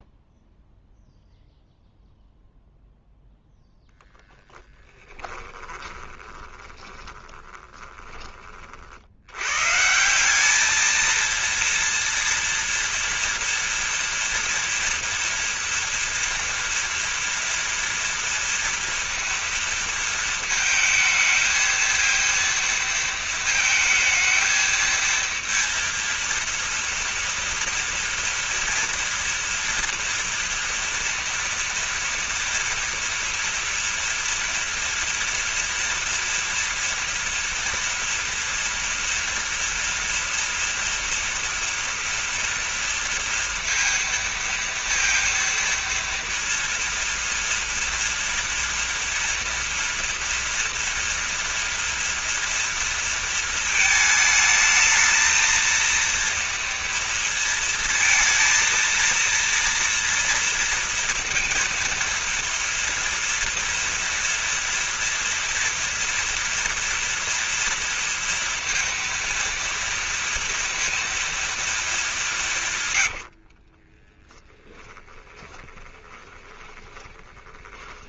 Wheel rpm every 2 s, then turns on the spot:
0, 0, 10, 20, 40, 210, 230, 230, 230, 230, 220, 230, 220, 230, 230, 230, 230, 230, 230, 230, 230, 230, 230, 230, 230, 230, 230, 220, 230, 230, 230, 230, 230, 230, 230, 230, 160, 10, 20.
4-8 74-78